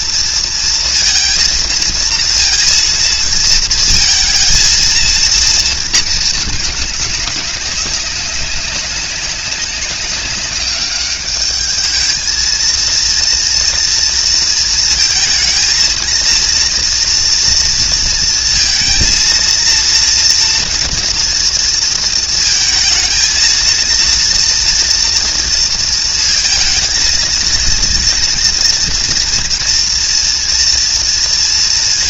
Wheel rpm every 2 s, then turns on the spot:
230, 230, 220, 210, 190, 200, 230, 230, 230, 230, 230, 230, 230, 220, 240, 230.
none